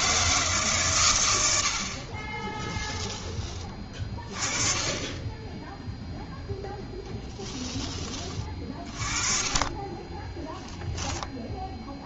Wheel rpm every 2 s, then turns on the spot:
140, 10, 20, 0, 30, 0.
2-4